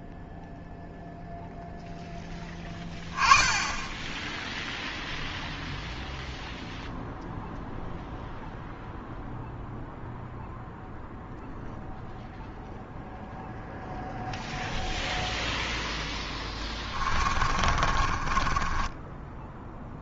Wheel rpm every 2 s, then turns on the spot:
0, 10, 0, 0, 0, 0, 0, 0, 20, 20.
16-20